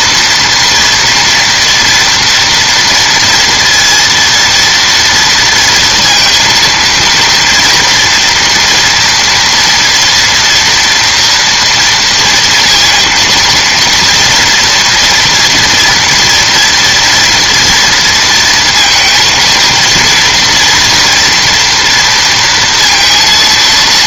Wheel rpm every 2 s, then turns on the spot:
230, 230, 230, 230, 230, 230, 230, 240, 230, 230, 230, 230.
none